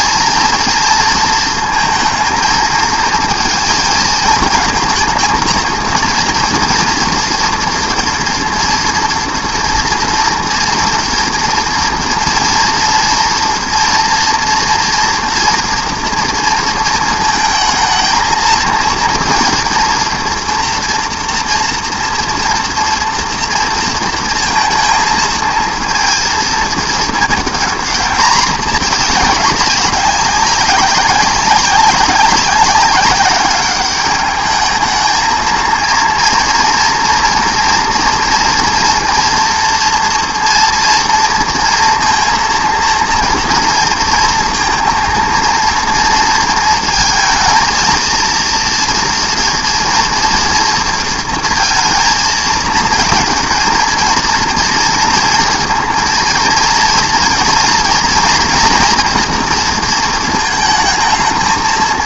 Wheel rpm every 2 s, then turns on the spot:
230, 230, 230, 230, 230, 230, 230, 230, 230, 230, 240, 230, 230, 220, 220, 200, 200, 210, 230, 230, 230, 230, 230, 230, 230, 230, 220, 230, 230, 230, 220.
none